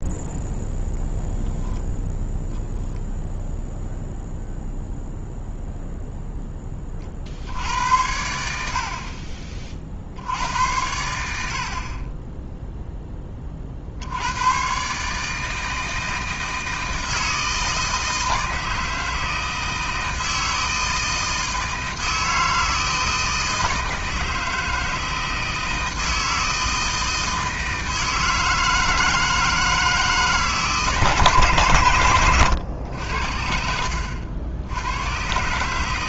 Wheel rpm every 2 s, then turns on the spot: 0, 0, 0, 10, 80, 80, 10, 90, 160, 160, 160, 160, 160, 160, 160, 150, 110, 70.
none